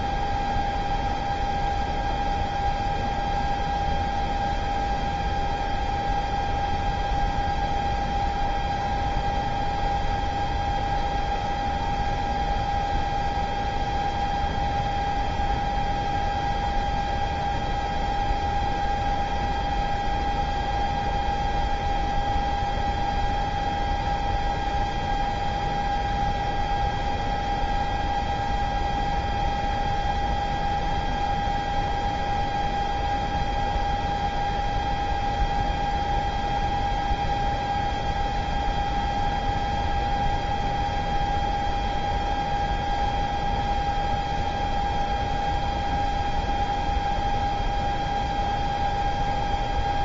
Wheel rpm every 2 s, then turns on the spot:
0, 0, 0, 0, 0, 0, 0, 0, 0, 0, 0, 0, 0, 0, 0, 0, 0, 0, 0, 0, 0, 0, 0, 0, 0.
none